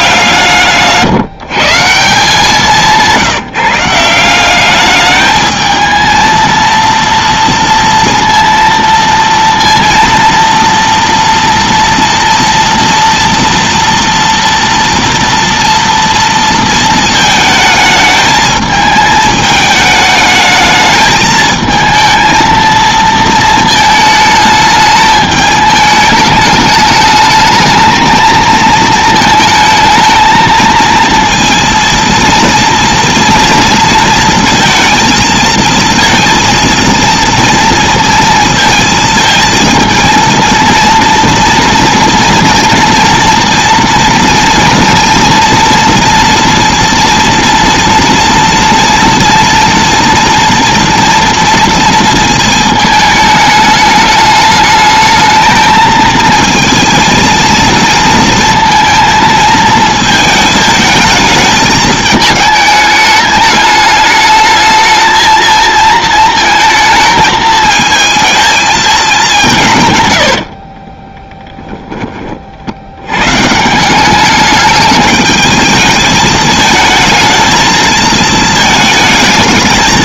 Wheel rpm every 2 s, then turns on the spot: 160, 170, 180, 230, 230, 230, 230, 230, 230, 220, 220, 230, 220, 210, 220, 220, 230, 230, 230, 230, 230, 230, 230, 230, 230, 230, 220, 210, 230, 230, 220, 220, 220, 220, 220, 90, 50, 210, 220, 220.
70-72